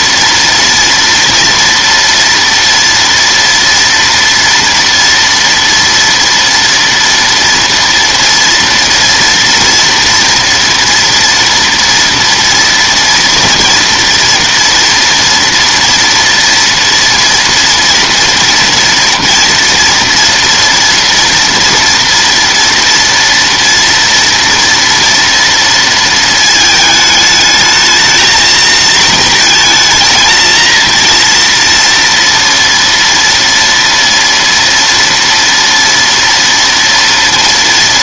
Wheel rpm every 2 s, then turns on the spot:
230, 230, 230, 230, 230, 240, 230, 230, 230, 230, 230, 230, 230, 220, 230, 230, 230, 230, 230.
none